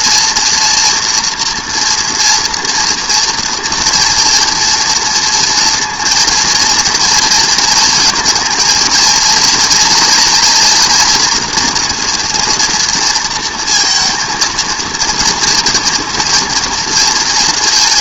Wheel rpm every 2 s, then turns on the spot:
230, 230, 230, 230, 220, 230, 240, 230, 230.
none